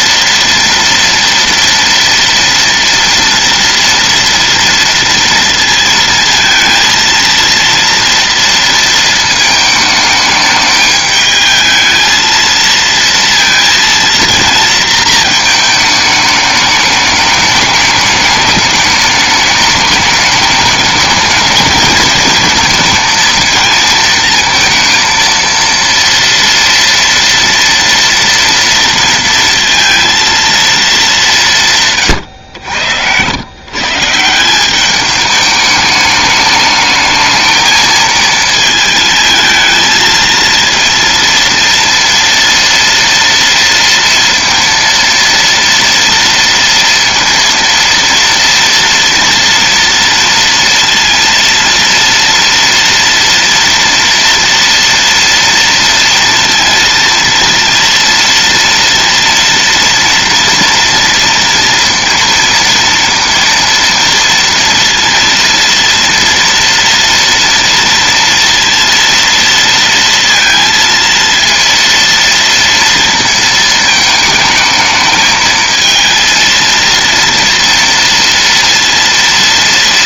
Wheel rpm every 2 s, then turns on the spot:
230, 230, 230, 230, 230, 220, 230, 220, 210, 210, 220, 230, 230, 230, 230, 200, 100, 210, 220, 220, 230, 230, 230, 230, 230, 230, 230, 230, 230, 240, 230, 230, 230, 230, 230, 230, 230, 220, 230, 230.
none